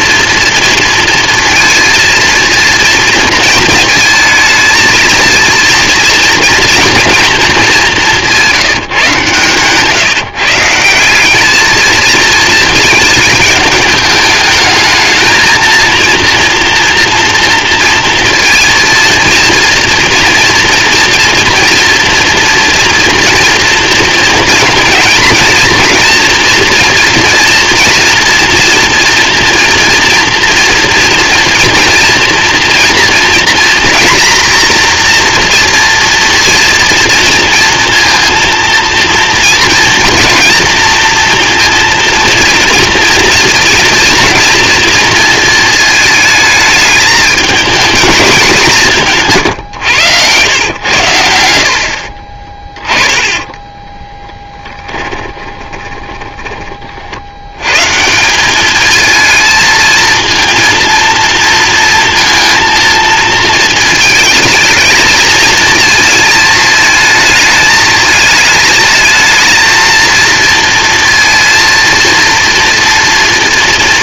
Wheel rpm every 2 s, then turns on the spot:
230, 230, 220, 230, 170, 160, 220, 210, 230, 230, 230, 230, 230, 230, 230, 230, 230, 240, 230, 230, 230, 230, 230, 220, 190, 110, 30, 20, 30, 210, 230, 230, 220, 220, 220, 230, 230.
50-56